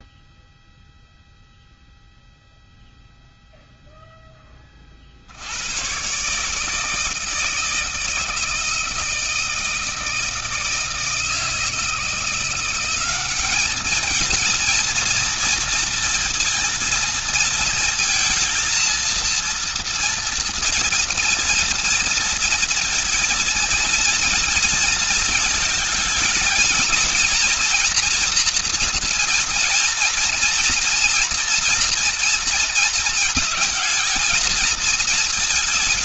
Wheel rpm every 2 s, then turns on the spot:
0, 0, 30, 150, 160, 160, 180, 230, 230, 230, 230, 230, 230, 230, 240, 230, 230, 220.
none